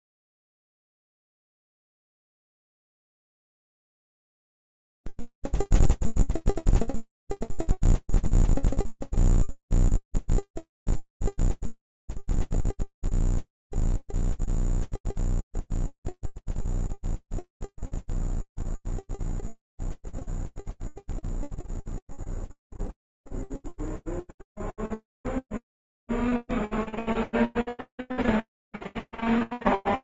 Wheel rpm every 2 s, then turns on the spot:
0, 0, 0, 0, 0, 0, 0, 0, 0, 0, 0, 0, 0, 0, 0.
none